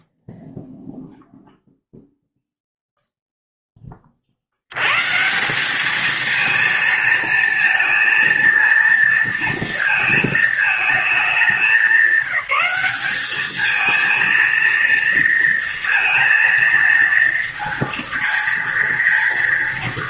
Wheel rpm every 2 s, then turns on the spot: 0, 0, 90, 230, 230, 220, 190, 230, 230, 230.
none